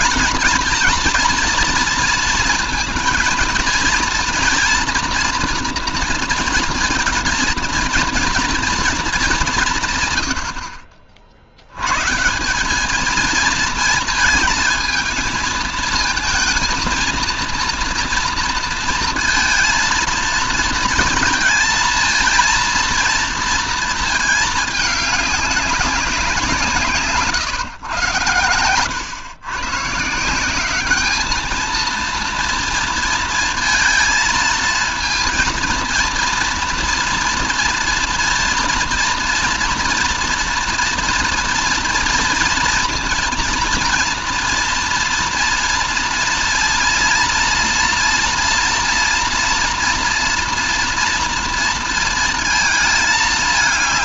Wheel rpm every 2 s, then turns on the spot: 240, 230, 230, 230, 240, 80, 180, 220, 230, 230, 230, 230, 220, 170, 110, 190, 230, 230, 230, 230, 230, 230, 240, 230, 240, 230, 220.
none